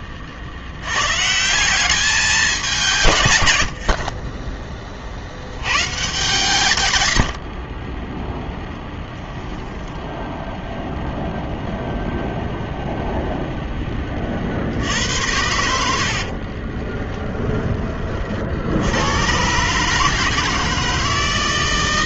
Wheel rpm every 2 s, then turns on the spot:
80, 190, 20, 130, 0, 0, 0, 60, 20, 70, 160.
16-18